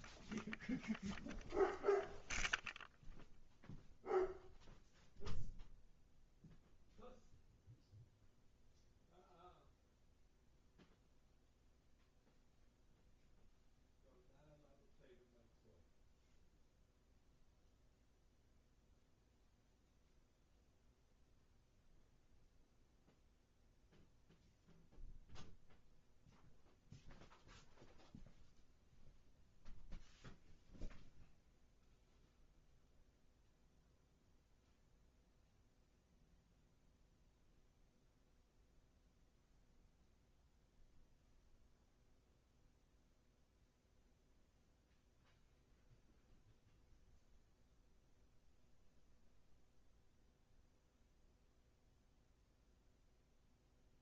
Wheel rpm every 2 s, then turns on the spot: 0, 0, 0, 0, 0, 0, 0, 0, 0, 0, 0, 0, 0, 0, 0, 0, 0, 0, 0, 0, 0, 0, 0, 0, 0, 0, 0.
none